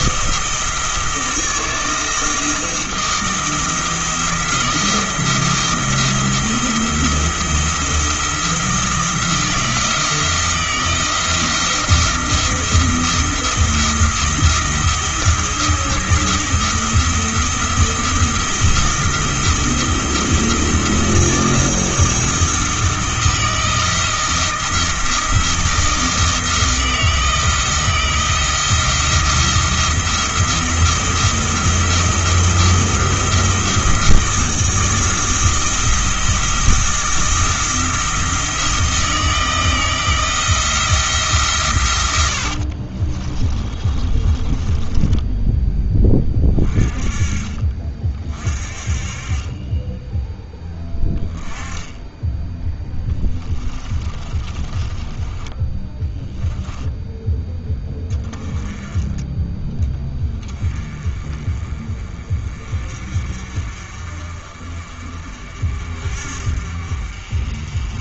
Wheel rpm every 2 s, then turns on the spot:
160, 160, 170, 170, 170, 170, 170, 170, 160, 170, 170, 160, 170, 160, 160, 170, 170, 170, 170, 160, 170, 50, 20, 30, 40, 10, 10, 20, 10, 20, 20, 40, 40, 50.
42-46 54-56